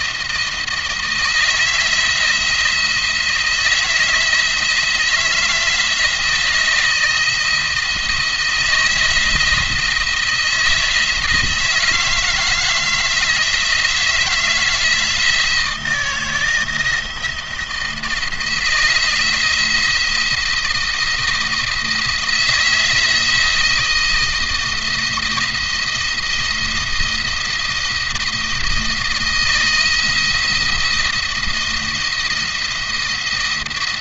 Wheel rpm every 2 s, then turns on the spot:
160, 160, 170, 160, 160, 170, 160, 160, 170, 170, 170, 160, 160, 170, 160, 170, 170.
none